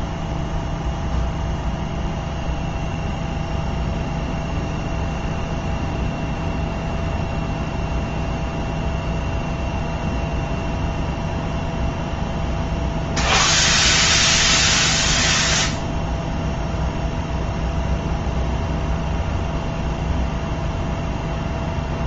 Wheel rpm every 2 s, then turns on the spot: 0, 0, 0, 0, 0, 0, 0, 0, 0, 0, 0.
none